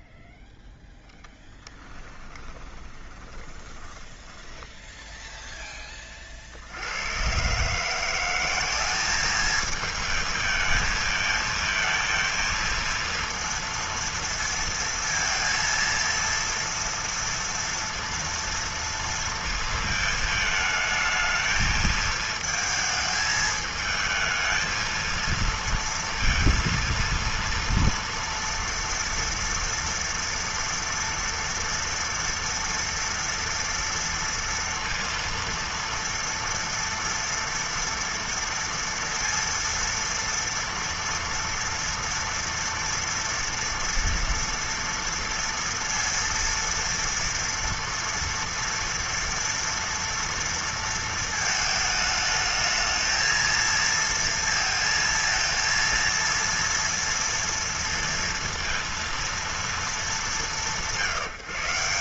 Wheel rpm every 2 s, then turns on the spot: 0, 20, 10, 40, 180, 220, 230, 230, 230, 230, 220, 220, 220, 230, 230, 230, 230, 230, 230, 230, 230, 230, 230, 230, 230, 230, 220, 230, 230, 230, 190.
2-6